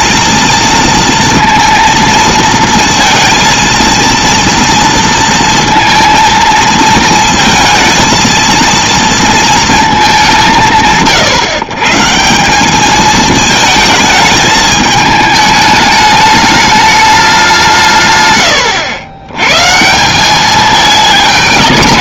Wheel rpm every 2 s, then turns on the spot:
230, 230, 230, 230, 230, 160, 210, 220, 210, 100, 210.
18-20